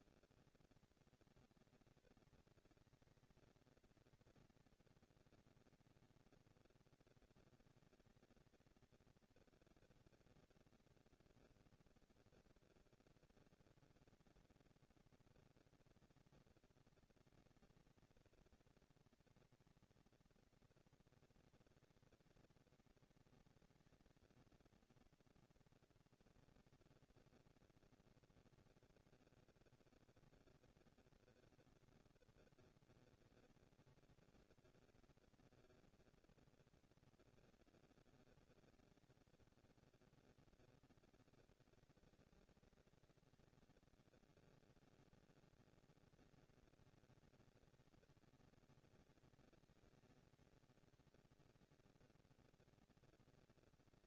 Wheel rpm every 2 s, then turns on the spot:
230, 230, 230, 230, 230, 230, 230, 230, 230, 240, 230, 230, 230, 230, 230, 230, 240, 230, 230, 210, 190, 200, 230, 230, 230, 230, 230.
none